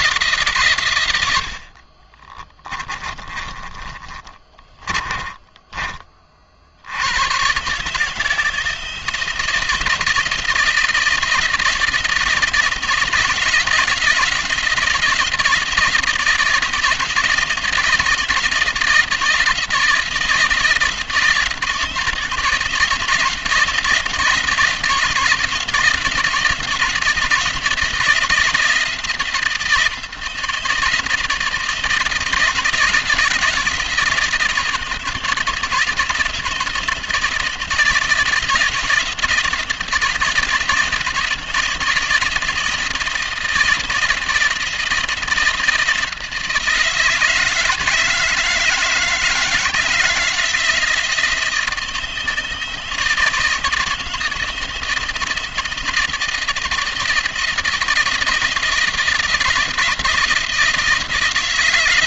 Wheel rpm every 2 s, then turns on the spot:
130, 30, 30, 70, 170, 170, 160, 170, 170, 170, 160, 170, 170, 170, 170, 170, 170, 160, 170, 180, 170, 170, 170, 160, 160, 170, 170, 160, 160, 160, 160.
2-6